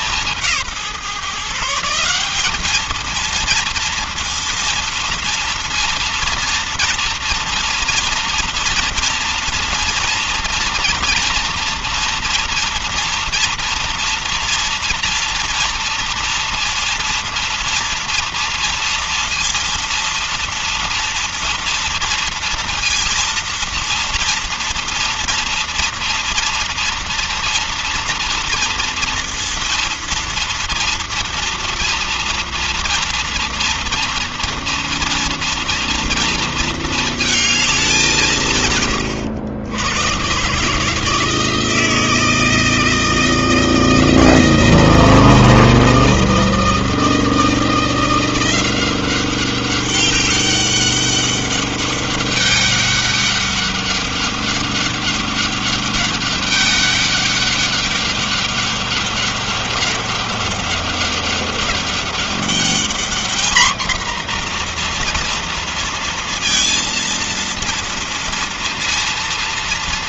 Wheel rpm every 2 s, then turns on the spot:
180, 190, 230, 230, 230, 230, 230, 230, 230, 230, 230, 230, 230, 230, 230, 230, 230, 230, 230, 140, 130, 160, 170, 160, 170, 200, 200, 200, 200, 200, 200, 200, 240, 230, 230.
none